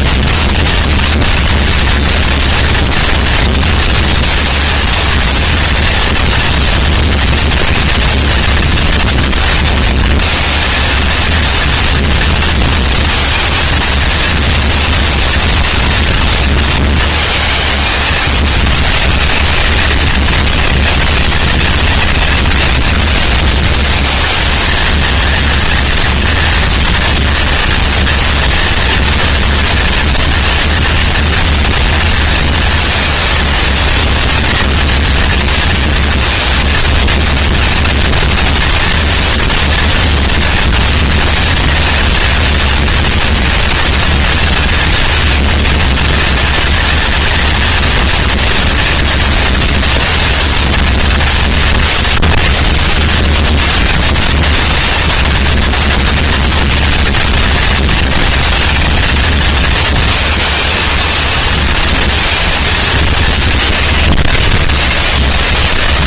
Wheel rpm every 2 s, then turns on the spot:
230, 230, 230, 230, 230, 230, 230, 230, 230, 210, 190, 200, 210, 230, 230, 230, 230, 230, 230, 220, 230, 230, 230, 230, 230, 230, 160, 220, 220, 220, 230, 230, 120.
none